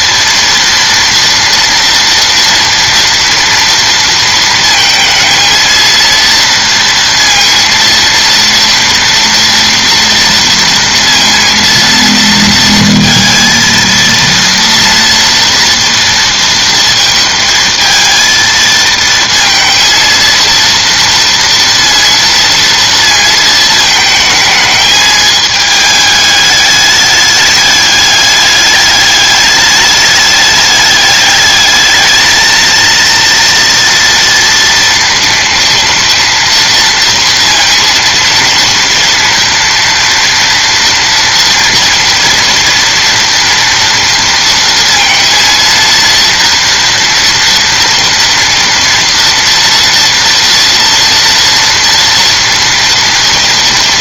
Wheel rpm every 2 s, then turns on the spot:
230, 230, 220, 230, 230, 230, 230, 230, 220, 230, 230, 230, 220, 210, 200, 210, 230, 230, 230, 230, 230, 230, 230, 230, 230, 230, 240.
none